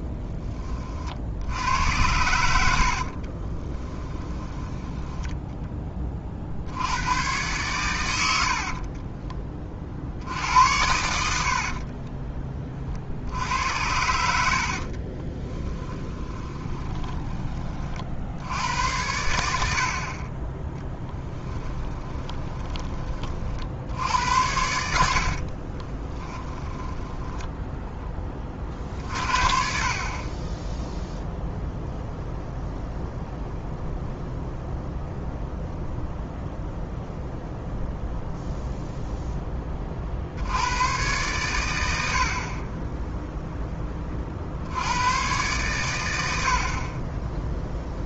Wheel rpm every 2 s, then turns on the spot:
50, 50, 10, 90, 30, 80, 50, 40, 20, 90, 10, 20, 80, 10, 50, 0, 0, 0, 0, 0, 110, 10, 90, 30.
2-6 8-10 14-18 20-22 24-28